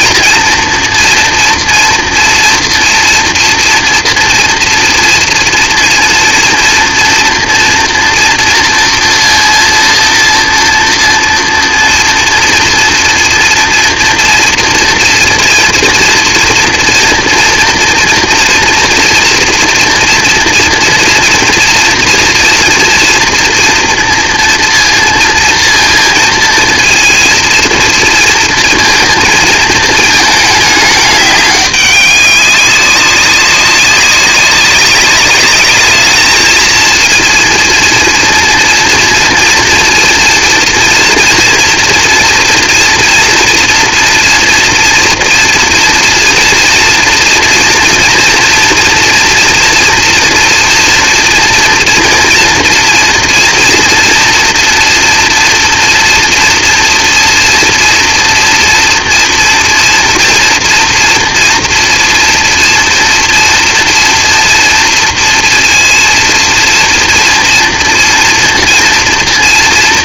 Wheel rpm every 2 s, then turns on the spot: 230, 240, 230, 230, 230, 230, 240, 230, 230, 230, 240, 230, 230, 230, 230, 210, 200, 190, 230, 230, 230, 240, 230, 230, 230, 230, 240, 240, 230, 230, 230, 230, 230, 230, 230.
none